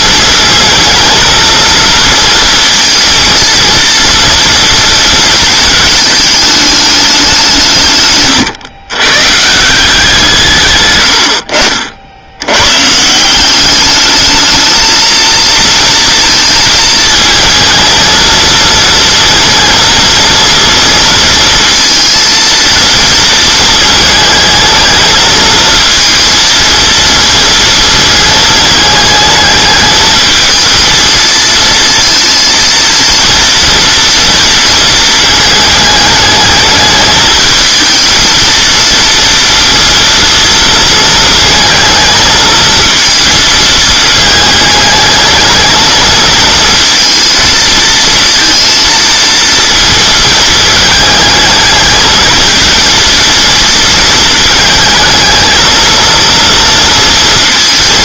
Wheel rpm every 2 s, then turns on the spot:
220, 230, 230, 210, 130, 130, 130, 220, 220, 230, 230, 230, 220, 230, 220, 220, 230, 230, 220, 230, 230, 220, 220, 230, 230, 220, 230, 220, 230.
none